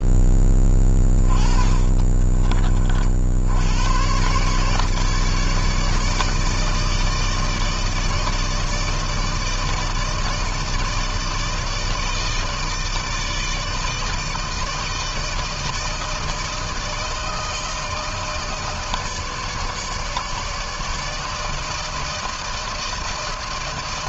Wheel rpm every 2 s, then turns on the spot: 20, 40, 140, 160, 160, 160, 160, 160, 160, 160, 150, 160.
0-2